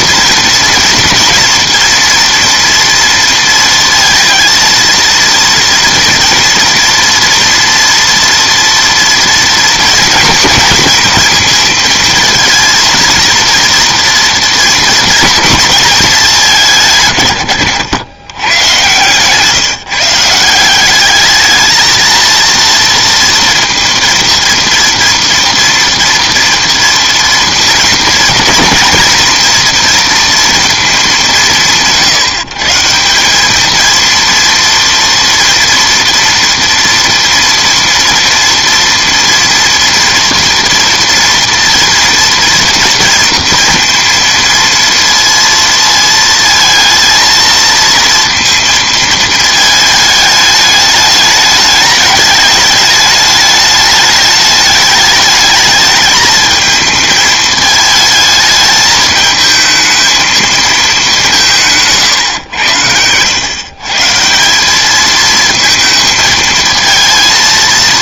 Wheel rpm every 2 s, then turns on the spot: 230, 230, 230, 230, 230, 240, 230, 230, 170, 120, 170, 230, 240, 230, 220, 230, 160, 230, 230, 230, 230, 230, 230, 220, 230, 210, 210, 210, 220, 220, 220, 110, 180, 220.
none